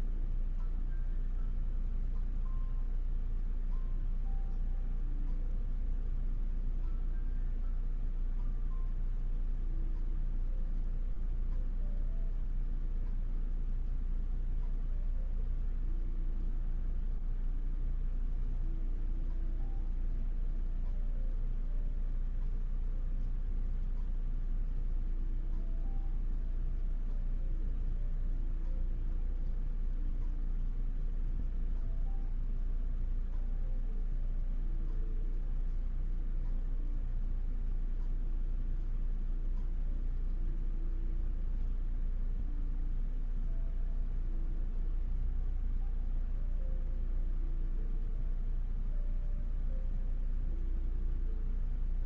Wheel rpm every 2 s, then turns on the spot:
0, 0, 0, 0, 0, 0, 0, 0, 0, 0, 0, 0, 0, 0, 0, 0, 0, 0, 0, 0, 0, 0, 0, 0, 0, 0.
none